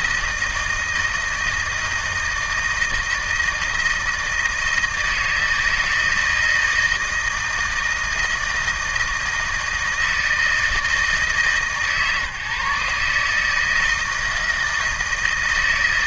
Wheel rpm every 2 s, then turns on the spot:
160, 160, 160, 160, 160, 160, 140, 160.
none